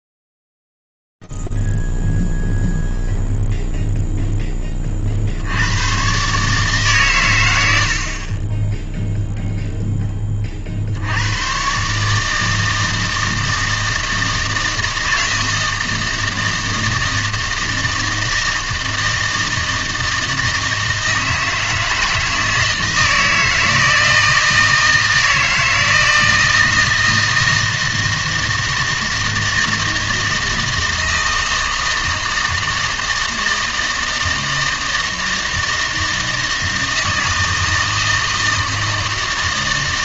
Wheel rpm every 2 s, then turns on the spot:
0, 0, 0, 120, 60, 10, 150, 160, 160, 160, 160, 160, 160, 160, 160, 160, 160, 160, 160, 160.
none